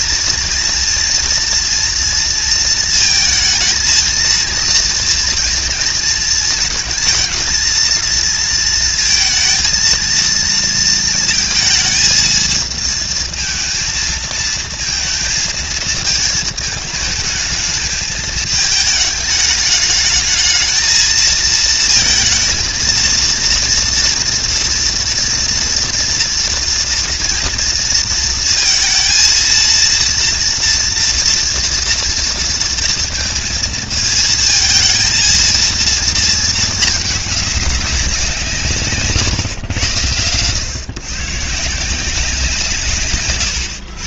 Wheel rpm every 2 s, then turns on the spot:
230, 220, 230, 230, 230, 230, 220, 230, 220, 220, 220, 230, 240, 230, 230, 230, 230, 230, 210, 150, 130, 150.
none